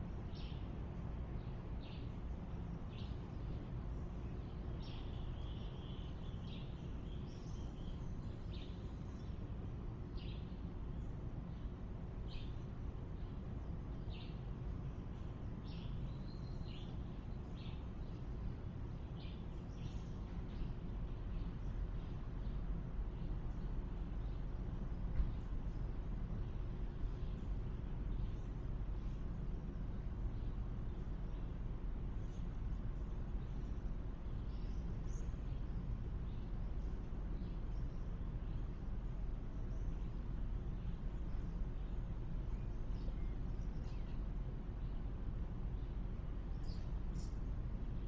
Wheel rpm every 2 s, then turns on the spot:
0, 0, 0, 0, 0, 0, 0, 0, 0, 0, 0, 0, 0, 0, 0, 0, 0, 0, 0, 0, 0, 0, 0, 0.
none